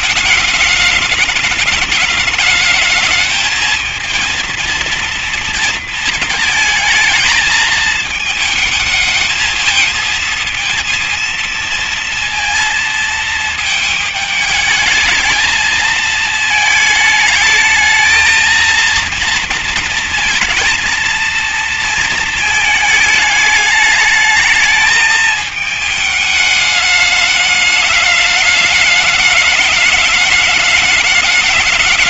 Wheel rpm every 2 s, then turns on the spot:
210, 210, 230, 230, 220, 230, 230, 220, 220, 220, 220, 220, 220, 210, 210, 210.
none